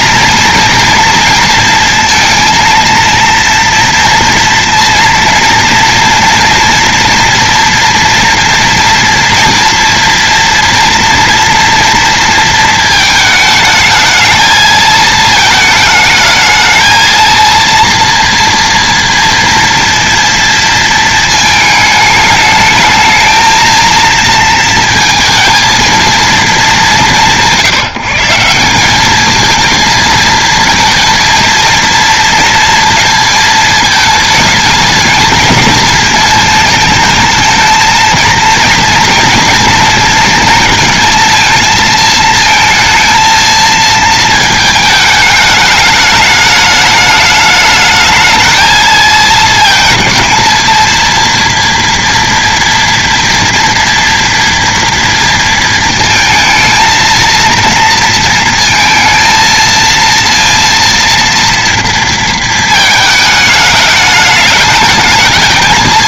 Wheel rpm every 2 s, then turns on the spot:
230, 230, 230, 230, 230, 230, 220, 220, 220, 230, 230, 220, 230, 170, 200, 230, 230, 220, 220, 230, 220, 220, 220, 210, 220, 230, 230, 230, 220, 230, 230, 220, 220.
none